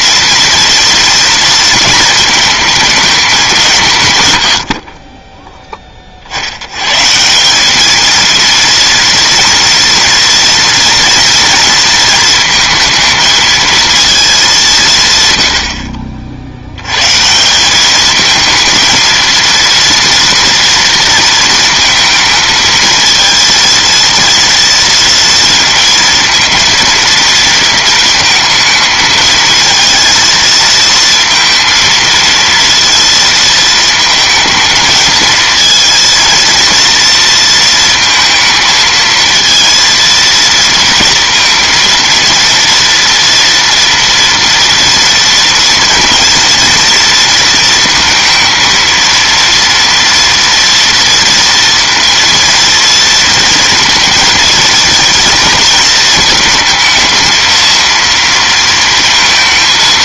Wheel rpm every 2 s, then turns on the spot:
230, 220, 70, 120, 230, 230, 220, 170, 100, 220, 230, 220, 230, 220, 220, 230, 230, 220, 230, 230, 230, 240, 230, 230, 230, 230, 230, 230, 220, 230.
none